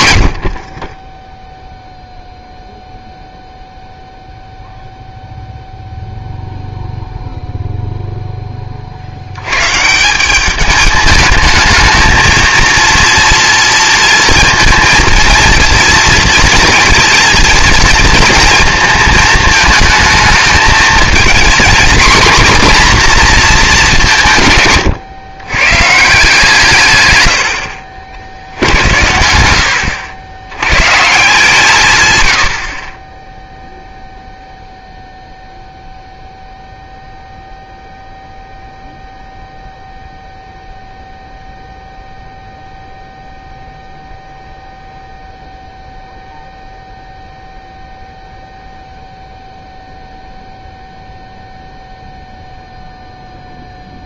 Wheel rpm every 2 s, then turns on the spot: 50, 0, 0, 0, 30, 210, 230, 230, 230, 220, 220, 240, 130, 150, 80, 110, 60, 0, 0, 0, 0, 0, 0, 0, 0, 0, 0.
none